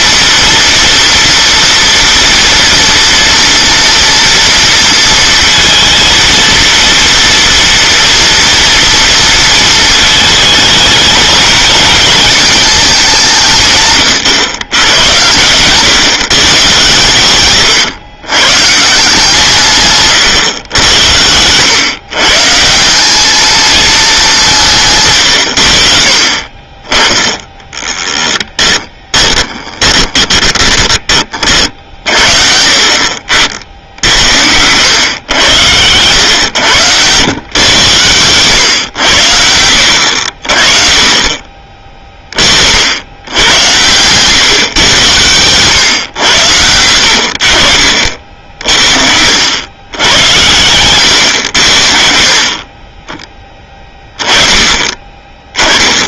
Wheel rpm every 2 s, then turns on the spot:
240, 240, 230, 230, 230, 220, 220, 110, 140, 150, 100, 170, 150, 30, 10, 20, 50, 100, 100, 110, 40, 60, 120, 80, 60, 100, 40, 20.
26-32 48-50